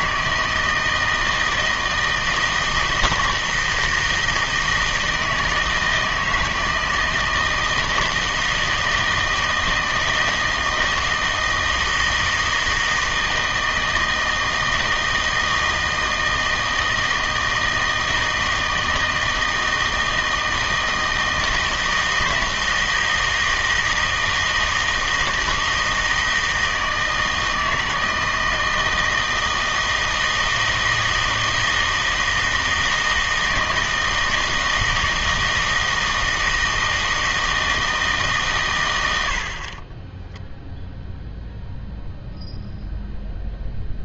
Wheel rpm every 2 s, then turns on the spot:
160, 160, 160, 160, 160, 160, 160, 160, 160, 160, 160, 160, 160, 160, 160, 160, 160, 160, 160, 110, 0, 0.
none